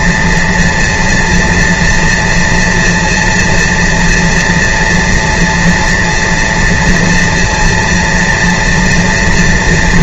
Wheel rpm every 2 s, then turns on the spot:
240, 230, 230, 230, 230.
none